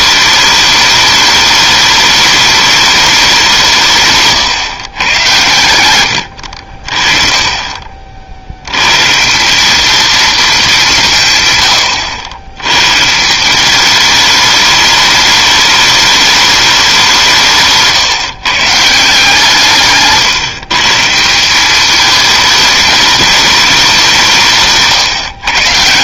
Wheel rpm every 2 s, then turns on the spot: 210, 210, 130, 60, 90, 200, 120, 210, 200, 150, 140, 220, 160.
none